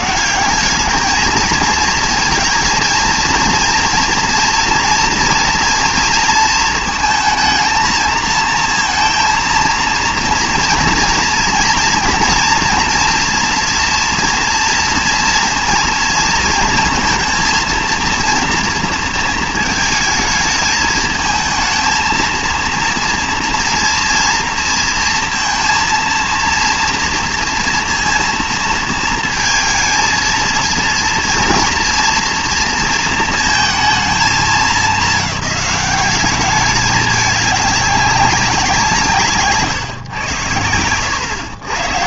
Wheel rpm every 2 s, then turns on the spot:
190, 230, 230, 220, 230, 230, 230, 230, 230, 230, 220, 230, 230, 230, 230, 230, 230, 220, 210, 190, 100.
none